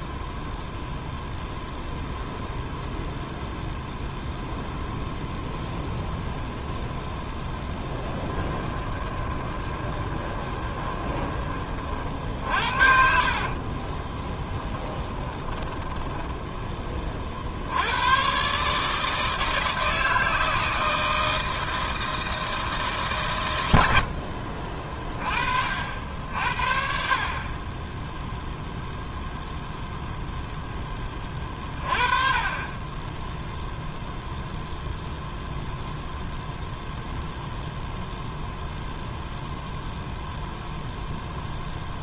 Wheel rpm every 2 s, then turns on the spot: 0, 0, 0, 0, 20, 20, 50, 10, 20, 150, 160, 150, 40, 50, 0, 10, 20, 0, 0, 0, 0.
8-16